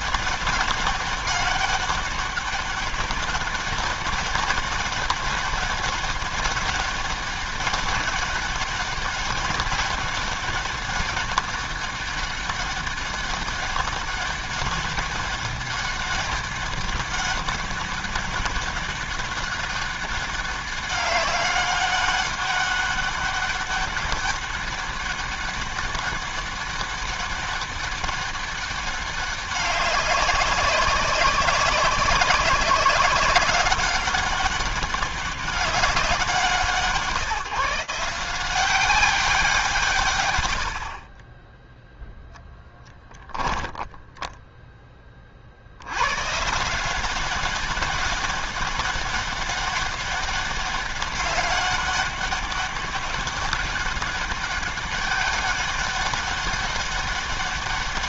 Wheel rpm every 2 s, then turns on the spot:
200, 200, 200, 200, 200, 200, 200, 200, 200, 200, 200, 200, 200, 200, 200, 190, 190, 190, 160, 190, 50, 10, 10, 160, 200, 200, 200, 200, 200.
none